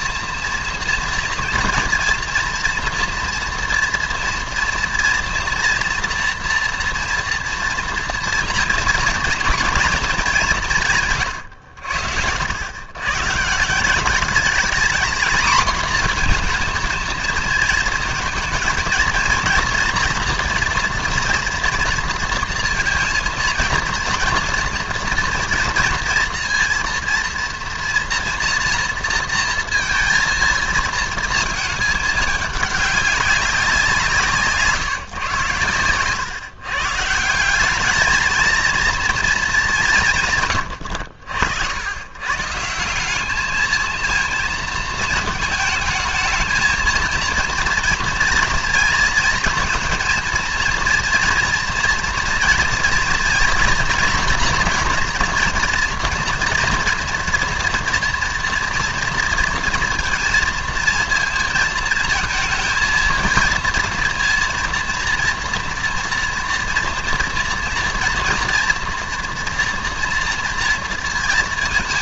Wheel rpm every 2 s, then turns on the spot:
230, 230, 230, 230, 230, 170, 90, 220, 230, 220, 230, 230, 230, 230, 230, 230, 200, 150, 140, 220, 100, 150, 230, 220, 230, 230, 230, 230, 240, 230, 230, 230, 230, 230, 230, 230.
none